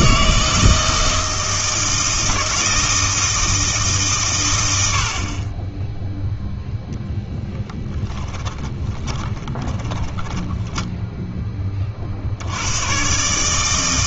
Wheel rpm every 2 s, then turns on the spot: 160, 160, 80, 0, 10, 10, 100.
8-12